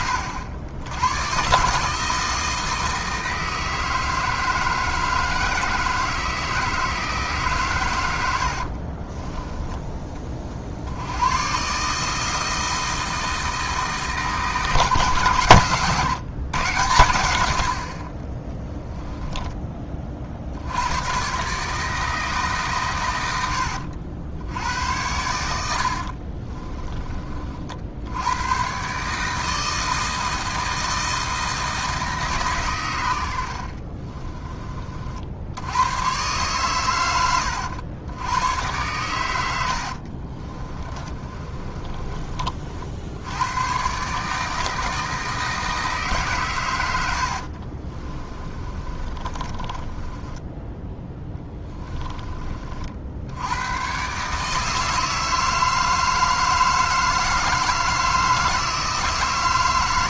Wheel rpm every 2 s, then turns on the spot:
90, 160, 160, 160, 60, 70, 160, 150, 120, 10, 90, 130, 90, 20, 140, 160, 110, 30, 120, 110, 30, 60, 160, 90, 30, 10, 40, 160, 160, 160.
8-10 18-20 40-42 48-52